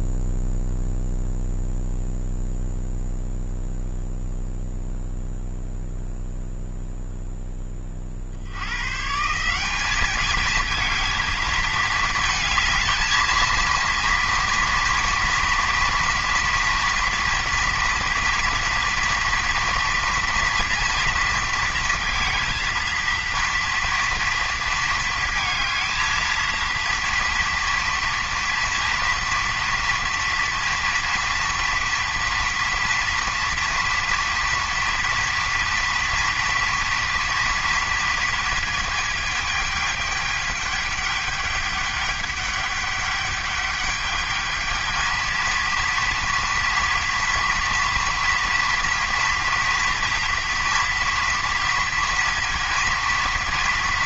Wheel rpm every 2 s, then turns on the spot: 0, 0, 0, 0, 120, 220, 220, 230, 230, 230, 230, 230, 230, 230, 230, 230, 230, 240, 240, 220, 210, 200, 220, 230, 230, 230, 230.
none